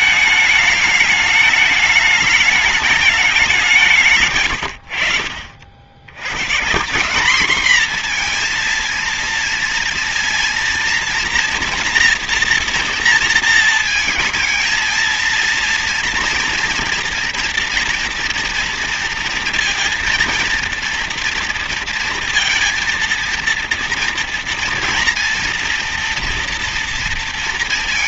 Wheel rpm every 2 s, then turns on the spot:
210, 210, 130, 150, 230, 230, 240, 230, 230, 230, 230, 230, 240, 240.
none